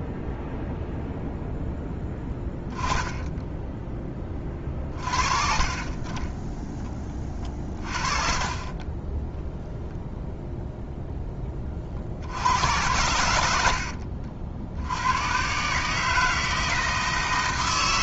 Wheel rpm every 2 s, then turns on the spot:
0, 10, 30, 10, 30, 0, 80, 70, 160.
2-4 8-10